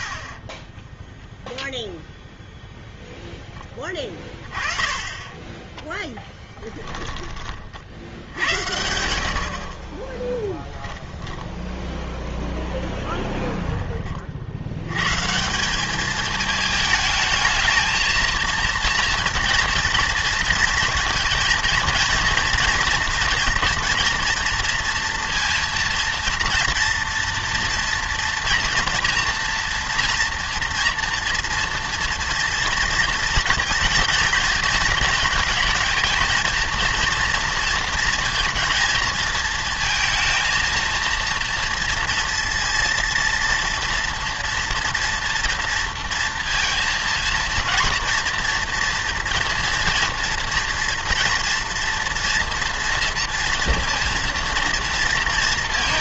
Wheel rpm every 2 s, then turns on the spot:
10, 0, 20, 20, 80, 10, 10, 80, 220, 230, 230, 230, 230, 230, 230, 240, 230, 220, 230, 230, 230, 230, 230, 230, 230, 230, 230, 230.
6-8 10-12